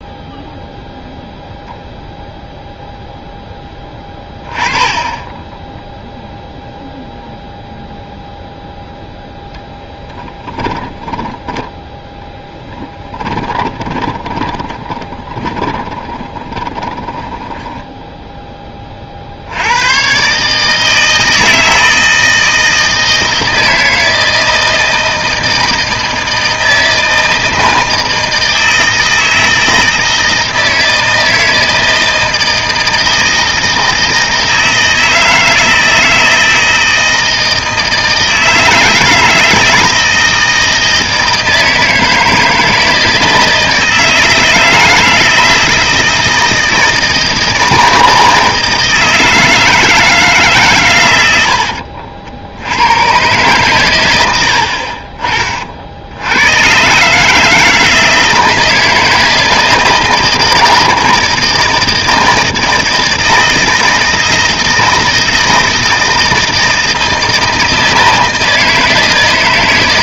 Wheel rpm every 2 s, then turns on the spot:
0, 0, 20, 0, 0, 20, 20, 20, 20, 20, 150, 160, 160, 160, 160, 160, 160, 160, 160, 160, 160, 160, 160, 160, 160, 130, 90, 50, 120, 160, 160, 160, 160, 170, 160.
10-18 54-56